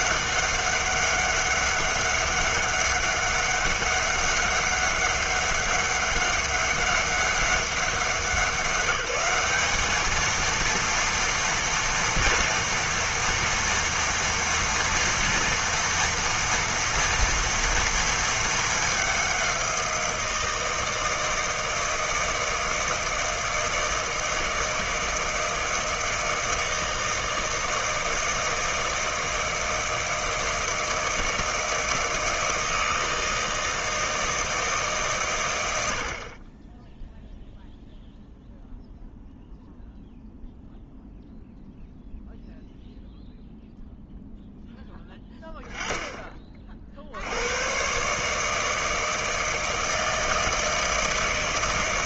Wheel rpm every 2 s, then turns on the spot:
200, 200, 200, 200, 180, 230, 230, 230, 230, 210, 160, 160, 160, 160, 160, 160, 160, 150, 10, 0, 0, 0, 10, 50, 160, 160.
none